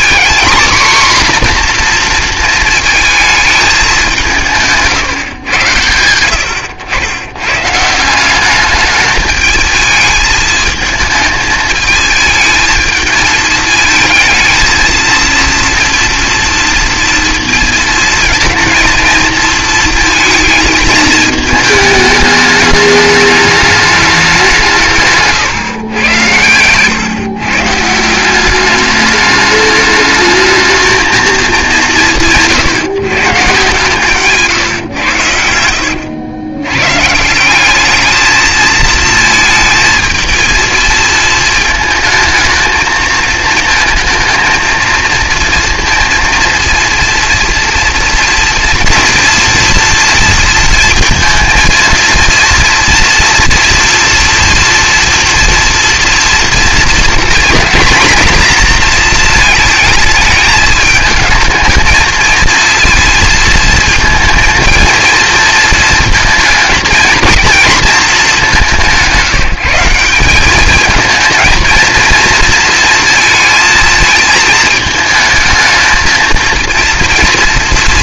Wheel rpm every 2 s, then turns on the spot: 250, 230, 180, 90, 200, 220, 220, 220, 230, 220, 220, 210, 170, 110, 200, 220, 150, 140, 110, 220, 220, 220, 230, 230, 230, 230, 230, 230, 230, 230, 220, 230, 230, 230, 190, 210, 230, 220, 230.
26-28 34-36